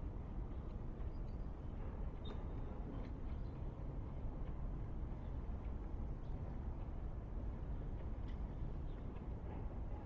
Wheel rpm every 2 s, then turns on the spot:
0, 0, 0, 0, 0.
none